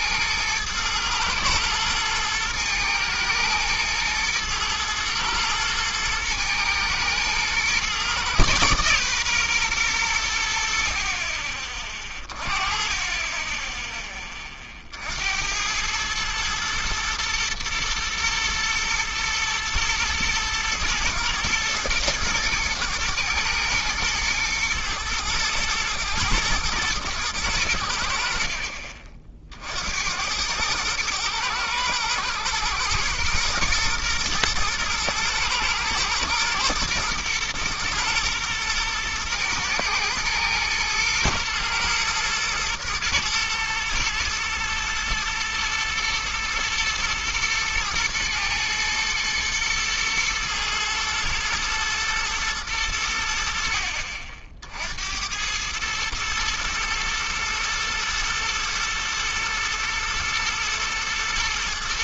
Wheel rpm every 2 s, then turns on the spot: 110, 110, 110, 120, 130, 70, 30, 40, 110, 110, 120, 110, 120, 110, 50, 100, 110, 120, 110, 110, 110, 120, 120, 110, 110, 110, 110, 60, 110, 120, 120.
none